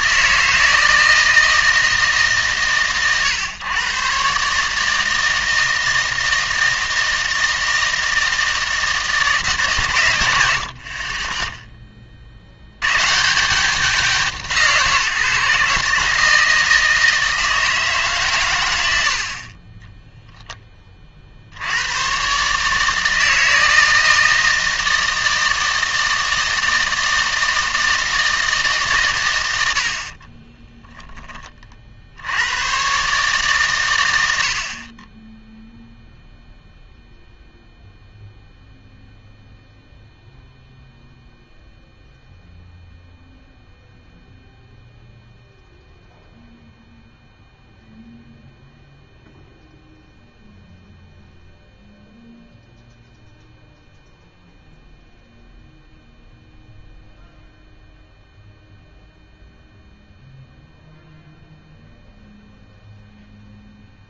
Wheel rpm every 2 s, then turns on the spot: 160, 110, 150, 160, 160, 60, 100, 150, 160, 90, 20, 150, 160, 160, 140, 10, 120, 50, 0, 0, 0, 0, 0, 0, 0, 0, 0, 0, 0, 0, 0, 0.
30-32